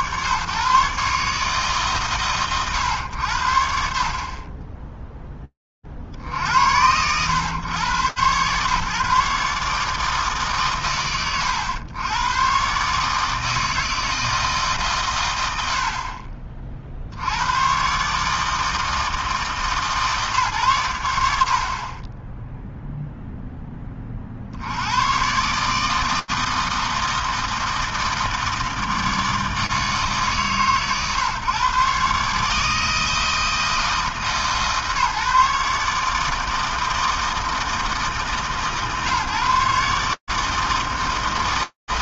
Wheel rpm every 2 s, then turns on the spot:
80, 140, 70, 30, 120, 150, 110, 160, 40, 140, 150, 50, 10, 140, 160, 160, 130, 160, 150, 160, 140.
none